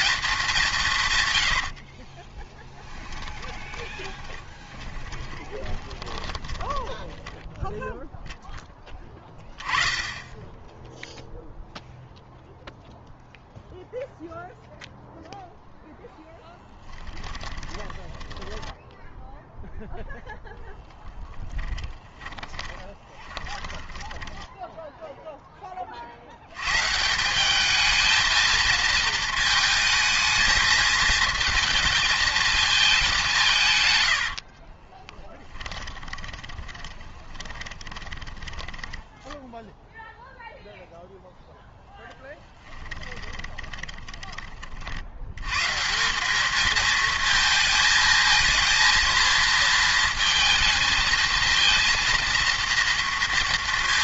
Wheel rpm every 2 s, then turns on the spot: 170, 10, 20, 10, 10, 10, 0, 0, 10, 10, 0, 10, 10, 120, 220, 220, 220, 40, 20, 10, 0, 20, 50, 220, 230, 220, 230.
2-6 16-20 22-26 34-40 42-44